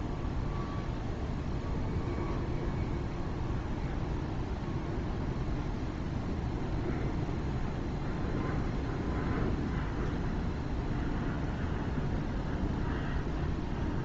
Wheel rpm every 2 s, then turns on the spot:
0, 0, 0, 0, 0, 0, 0.
none